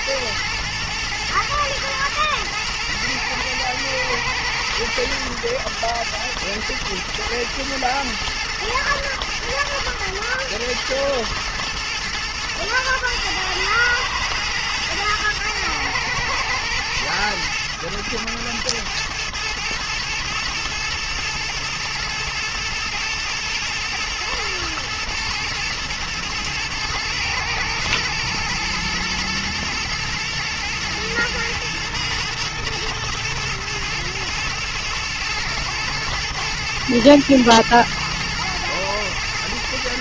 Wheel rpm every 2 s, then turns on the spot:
120, 110, 120, 120, 110, 120, 110, 110, 110, 110, 110, 110, 120, 120, 110, 120, 110, 110, 110, 110.
none